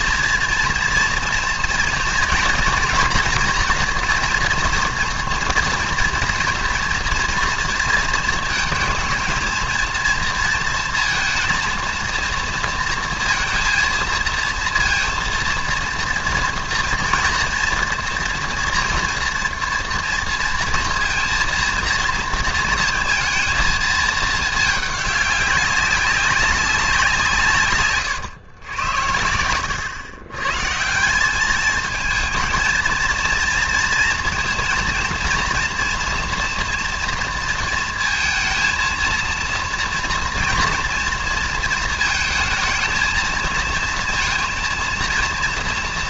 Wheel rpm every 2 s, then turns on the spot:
230, 240, 230, 240, 220, 230, 230, 230, 230, 230, 230, 230, 210, 190, 90, 150, 220, 230, 230, 220, 230, 220, 230.
none